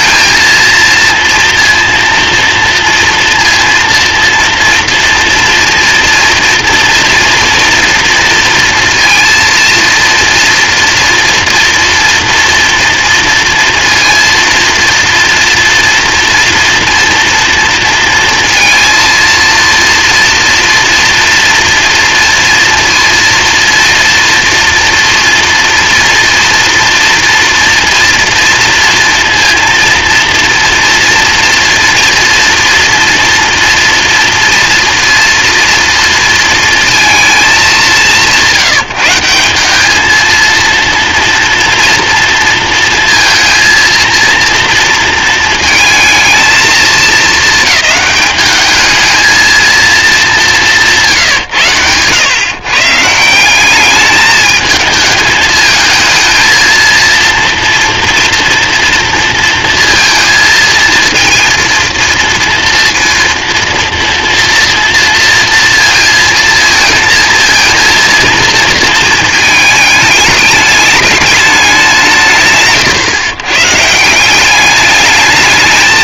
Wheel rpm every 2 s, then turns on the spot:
230, 230, 230, 240, 230, 230, 230, 230, 240, 230, 230, 230, 230, 230, 240, 230, 240, 230, 240, 200, 200, 230, 230, 220, 210, 220, 120, 190, 220, 240, 230, 230, 230, 230, 230, 220, 190, 150.
none